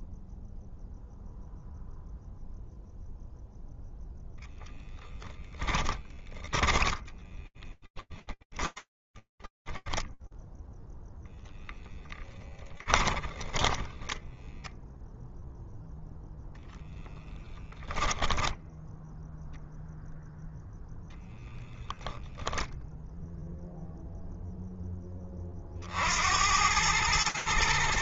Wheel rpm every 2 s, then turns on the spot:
0, 0, 0, 10, 10, 10, 10, 10, 0, 10, 10, 0, 40, 110.
6-12 14-16